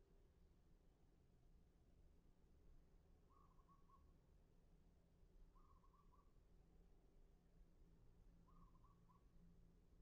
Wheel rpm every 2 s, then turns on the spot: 0, 0, 0, 0, 0.
none